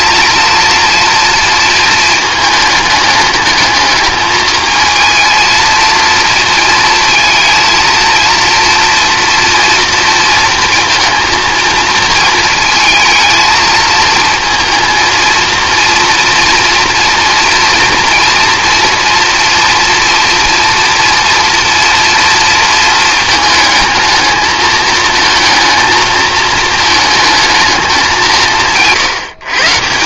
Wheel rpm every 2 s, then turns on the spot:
230, 210, 220, 220, 230, 230, 220, 220, 230, 230, 230, 230, 220, 220, 150.
none